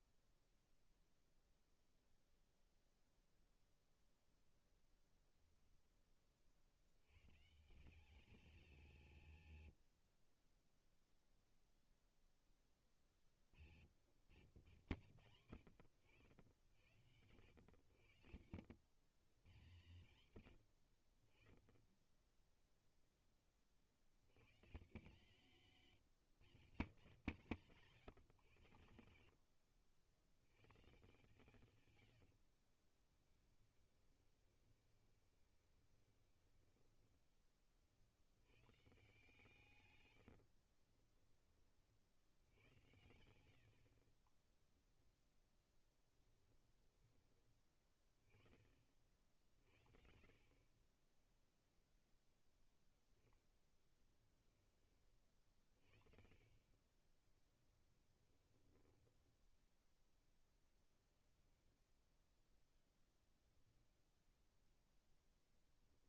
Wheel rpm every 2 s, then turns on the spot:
0, 0, 10, 100, 160, 0, 30, 110, 100, 100, 60, 10, 150, 150, 90, 150, 40, 20, 20, 140, 30, 80, 20, 10, 40, 20, 10, 30, 20, 10, 0, 0, 0.
30-36 40-42 44-46 56-60